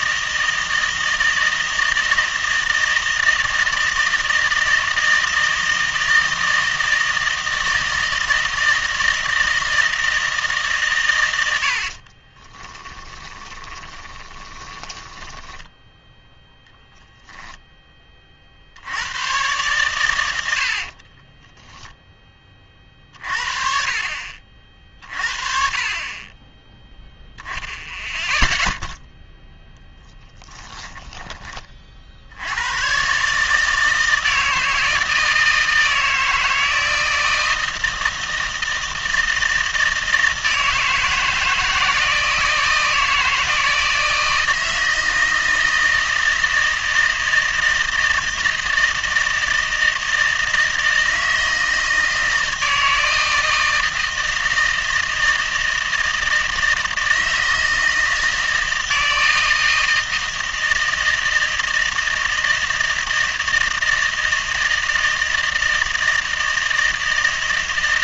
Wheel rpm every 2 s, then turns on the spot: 160, 160, 160, 160, 160, 140, 20, 20, 0, 60, 60, 30, 50, 10, 0, 10, 110, 160, 160, 160, 160, 160, 160, 160, 160, 160, 160, 160, 160, 160, 160, 160, 160, 160.
12-16 30-32